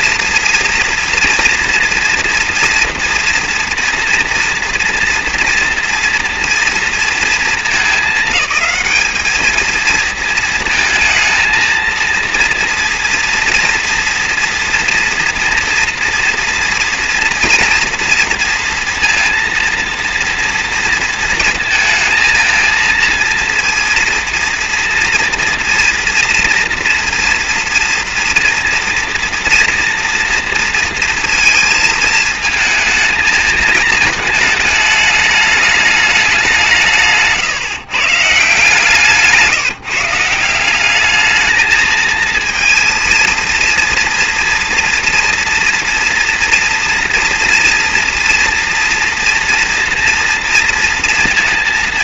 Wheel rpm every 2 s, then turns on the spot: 230, 230, 230, 240, 210, 220, 230, 230, 230, 230, 230, 230, 230, 240, 230, 230, 220, 210, 180, 150, 170, 220, 230, 230, 240, 230.
none